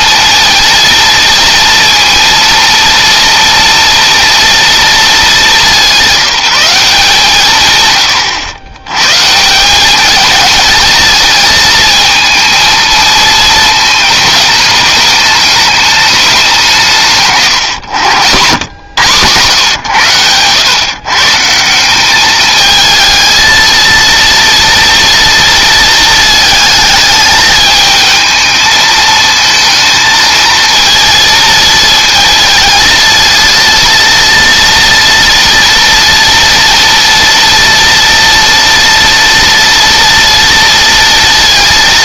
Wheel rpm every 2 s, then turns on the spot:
230, 230, 220, 150, 130, 220, 220, 210, 150, 100, 140, 220, 230, 220, 220, 230, 230, 230, 230, 230, 230.
none